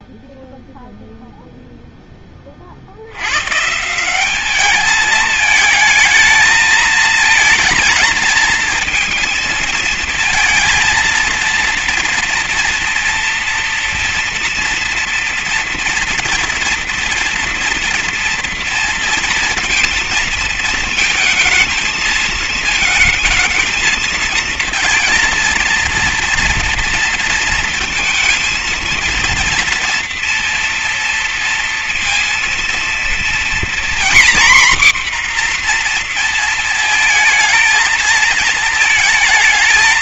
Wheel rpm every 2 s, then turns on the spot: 0, 60, 210, 220, 230, 230, 230, 240, 230, 230, 220, 220, 230, 230, 230, 230, 230, 260, 230, 220.
none